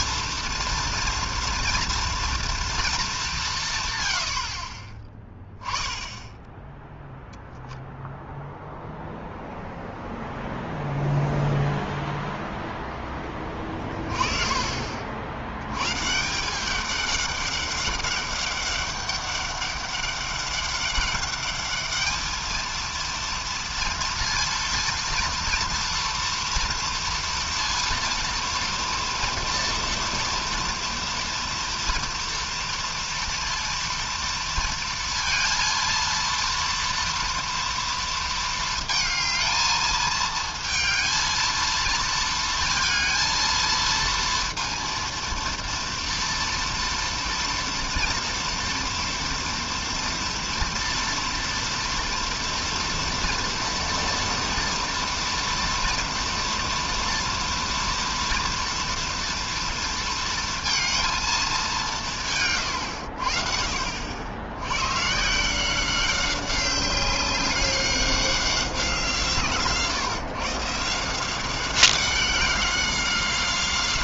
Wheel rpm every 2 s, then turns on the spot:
230, 230, 70, 0, 0, 0, 0, 30, 170, 200, 200, 220, 230, 230, 230, 230, 230, 230, 230, 230, 220, 230, 230, 230, 230, 230, 230, 230, 240, 230, 230, 140, 100, 190, 190, 140, 190.
none